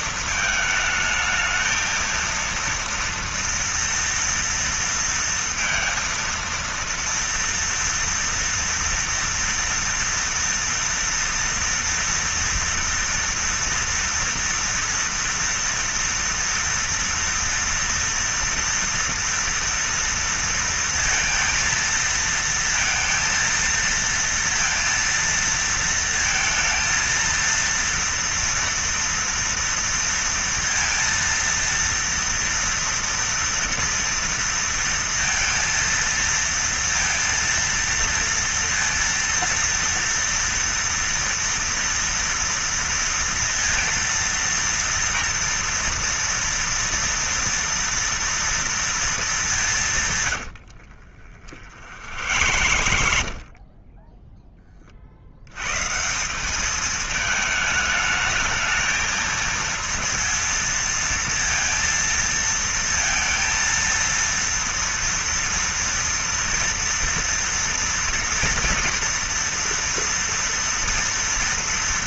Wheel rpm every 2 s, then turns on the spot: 220, 230, 230, 230, 230, 230, 230, 230, 230, 230, 230, 230, 230, 230, 230, 230, 230, 230, 230, 230, 230, 230, 230, 230, 230, 100, 80, 10, 180, 220, 230, 230, 230, 230, 230, 230.
50-54